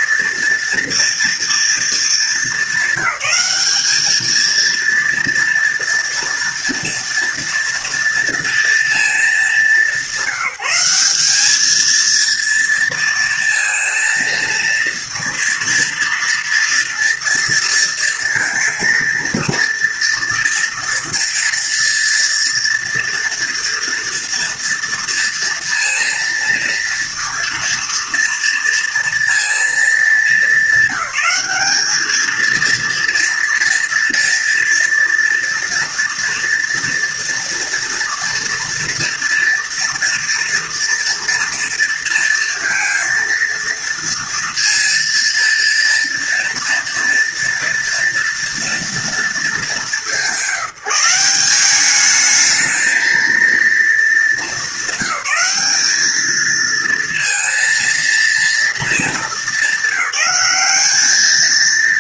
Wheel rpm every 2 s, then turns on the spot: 240, 210, 220, 230, 230, 180, 230, 230, 230, 230, 240, 230, 230, 230, 230, 210, 220, 230, 230, 230, 230, 230, 230, 230, 230, 180, 210, 210, 220, 230, 200.
none